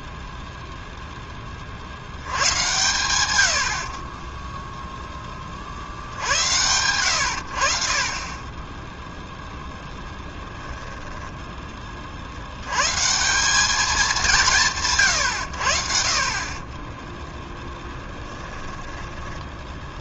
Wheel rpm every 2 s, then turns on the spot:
0, 110, 0, 90, 10, 10, 130, 140, 10, 10.
10-12 16-20